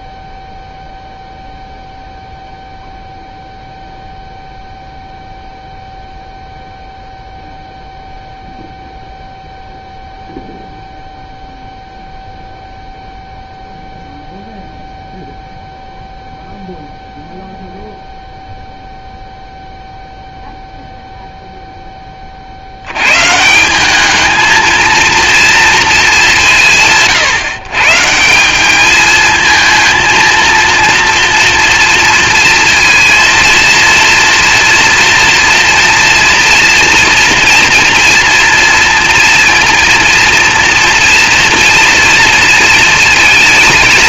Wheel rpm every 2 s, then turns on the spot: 0, 0, 0, 0, 0, 0, 0, 0, 0, 0, 0, 100, 230, 160, 220, 230, 230, 230, 240, 230, 230, 220.
none